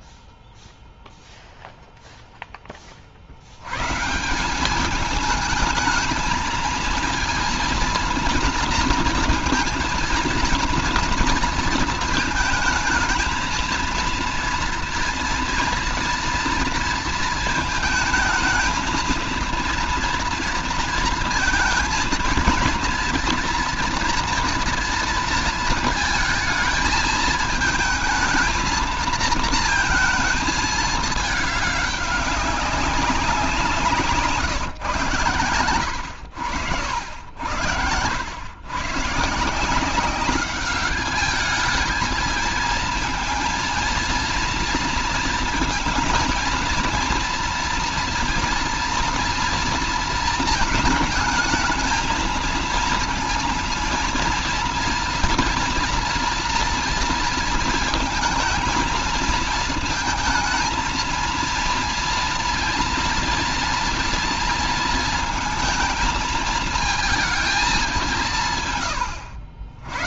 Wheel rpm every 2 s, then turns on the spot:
0, 10, 180, 220, 230, 230, 220, 230, 230, 220, 230, 230, 230, 220, 220, 220, 200, 140, 90, 120, 200, 230, 230, 230, 230, 220, 230, 230, 230, 230, 220, 230, 230, 220, 160.
none